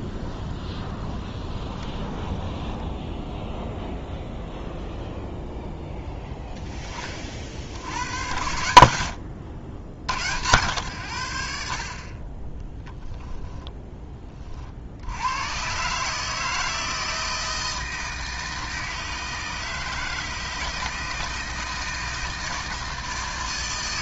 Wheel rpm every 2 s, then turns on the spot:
20, 10, 0, 20, 80, 110, 10, 60, 160, 160, 160, 160.
0-4